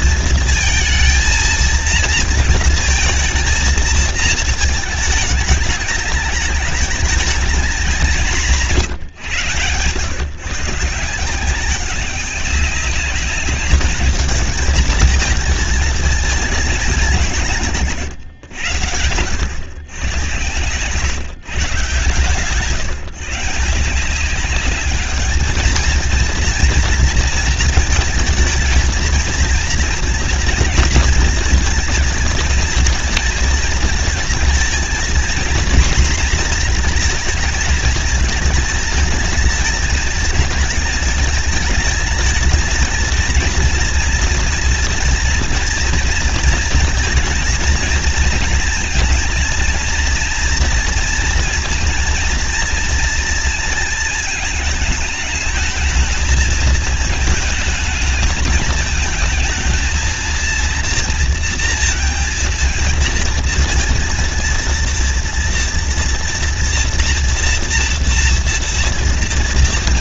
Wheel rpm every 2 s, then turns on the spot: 230, 230, 220, 210, 170, 160, 200, 220, 190, 100, 130, 140, 210, 230, 220, 230, 230, 230, 230, 220, 220, 220, 230, 230, 240, 230, 230, 210, 220, 220, 230, 230, 230, 230, 230.
none